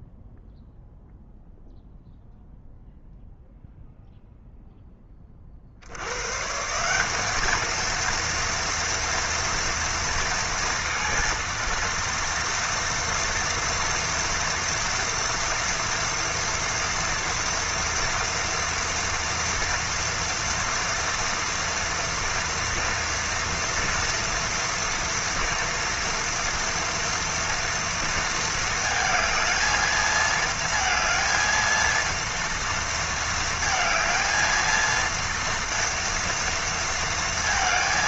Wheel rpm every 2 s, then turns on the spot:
0, 0, 0, 160, 230, 230, 230, 230, 230, 230, 240, 240, 230, 230, 220, 230, 230, 230, 230.
none